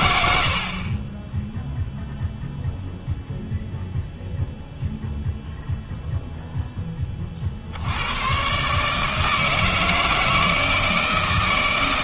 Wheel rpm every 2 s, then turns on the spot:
40, 0, 0, 10, 150, 150.
none